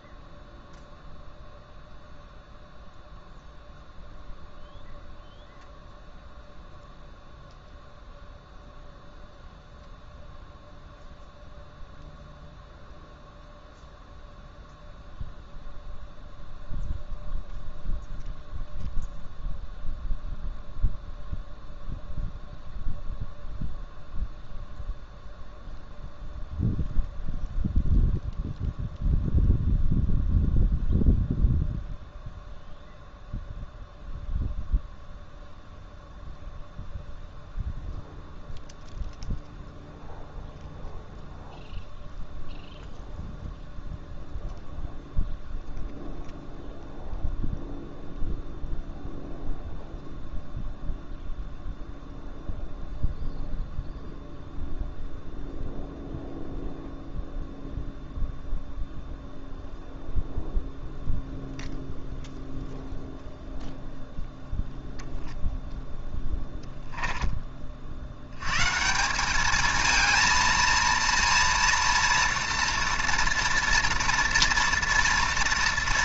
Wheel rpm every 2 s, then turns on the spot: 0, 0, 0, 0, 0, 0, 0, 0, 0, 0, 0, 0, 0, 0, 0, 0, 0, 0, 0, 0, 0, 0, 0, 0, 0, 0, 0, 0, 0, 0, 0, 0, 0, 10, 150, 230, 240, 220.
none